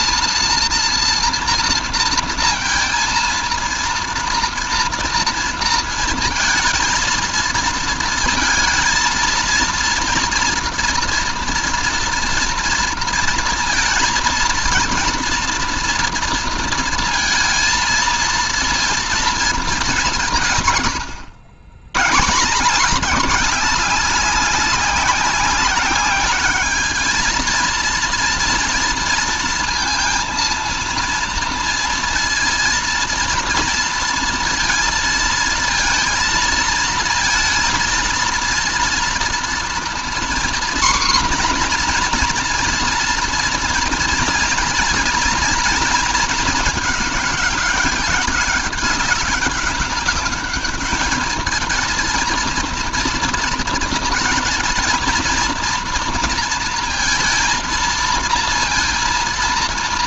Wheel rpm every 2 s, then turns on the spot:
240, 230, 230, 220, 230, 230, 230, 230, 230, 230, 120, 190, 190, 210, 230, 230, 230, 230, 230, 230, 250, 240, 230, 210, 190, 210, 230, 230, 230, 230.
none